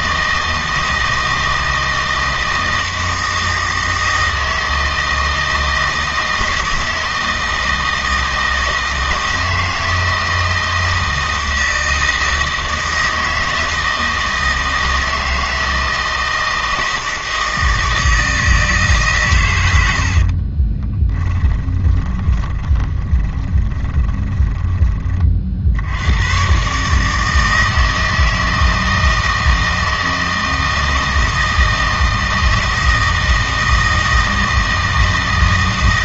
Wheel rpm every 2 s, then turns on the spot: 160, 160, 160, 160, 160, 160, 160, 160, 160, 150, 30, 20, 20, 140, 160, 160, 160, 160.
20-24